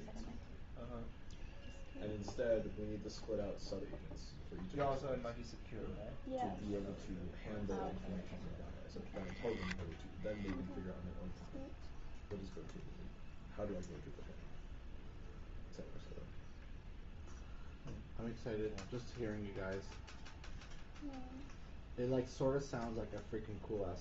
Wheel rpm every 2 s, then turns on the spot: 0, 0, 0, 0, 0, 0, 0, 0, 0, 0, 0, 0.
none